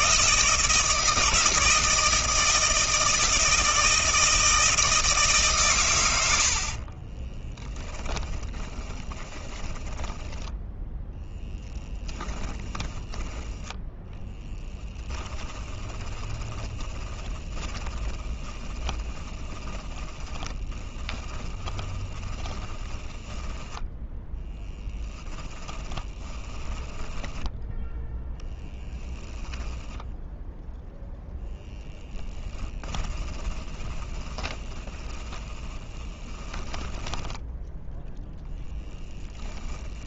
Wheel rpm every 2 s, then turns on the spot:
160, 160, 160, 30, 20, 10, 20, 10, 20, 20, 20, 20, 10, 10, 10, 0, 20, 20, 10, 10.
6-30 32-40